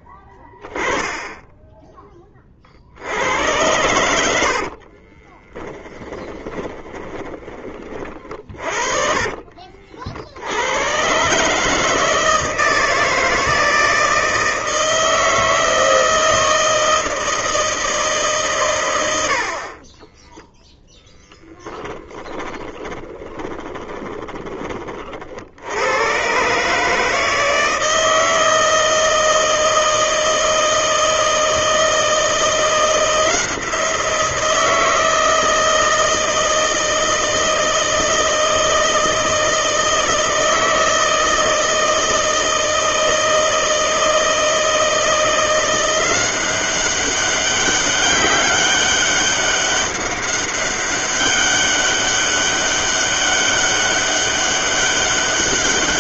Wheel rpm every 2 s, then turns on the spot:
10, 60, 60, 20, 40, 110, 160, 160, 160, 110, 0, 20, 30, 140, 160, 160, 160, 170, 160, 160, 160, 160, 160, 190, 200, 200, 200, 200.
4-10 22-24